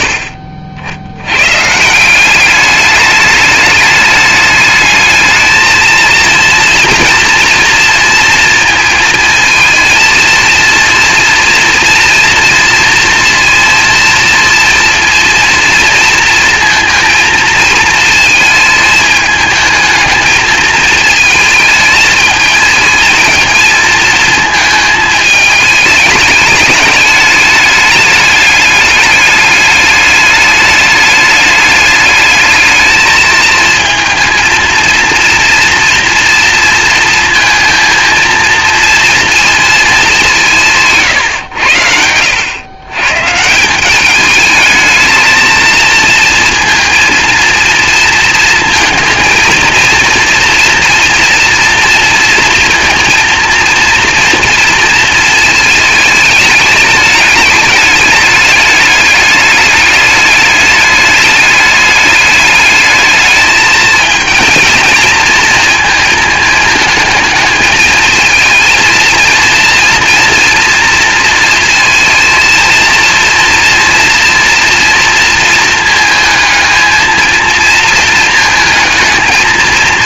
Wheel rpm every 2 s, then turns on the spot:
70, 200, 210, 230, 220, 230, 230, 230, 230, 220, 220, 220, 220, 210, 210, 210, 220, 230, 230, 230, 140, 120, 220, 230, 230, 240, 230, 230, 210, 210, 210, 210, 230, 220, 230, 230, 230, 230, 220, 220.
none